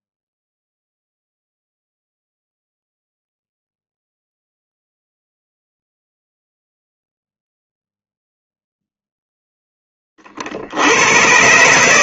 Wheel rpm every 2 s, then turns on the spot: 0, 0, 0, 0, 0, 70.
none